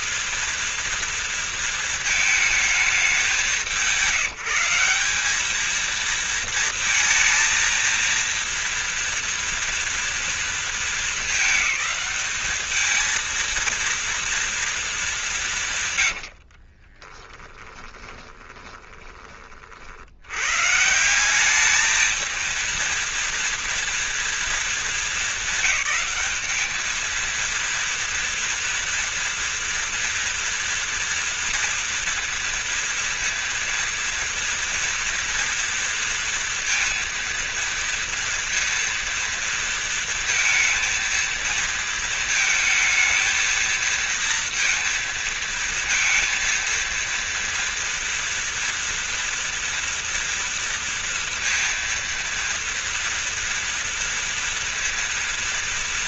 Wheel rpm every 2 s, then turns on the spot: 230, 220, 180, 230, 230, 230, 210, 230, 80, 20, 90, 220, 230, 200, 230, 230, 230, 230, 230, 230, 230, 220, 230, 230, 230, 230, 230, 230.
16-20